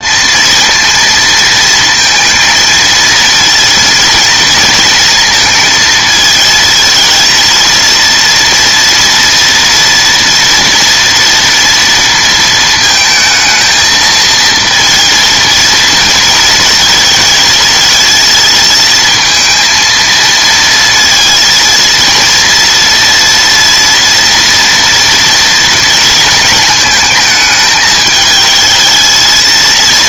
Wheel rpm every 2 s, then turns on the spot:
230, 230, 230, 220, 230, 230, 230, 230, 230, 230, 230, 240, 230, 220, 220.
none